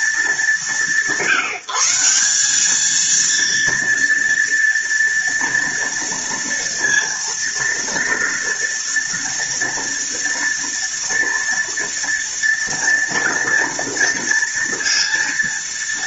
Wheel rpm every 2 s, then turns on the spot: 190, 220, 230, 230, 230, 230, 230, 230.
none